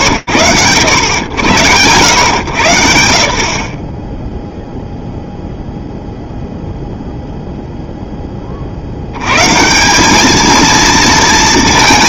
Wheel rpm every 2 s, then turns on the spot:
90, 70, 0, 0, 90, 230.
none